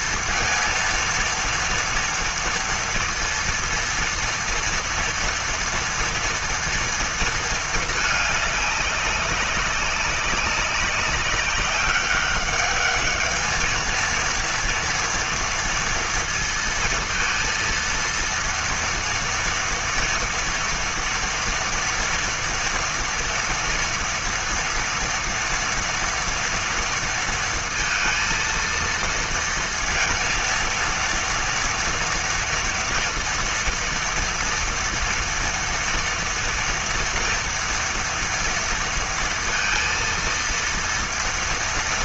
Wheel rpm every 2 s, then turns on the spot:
230, 230, 230, 230, 200, 200, 200, 230, 230, 230, 230, 230, 230, 230, 230, 230, 230, 230, 230, 230, 230.
none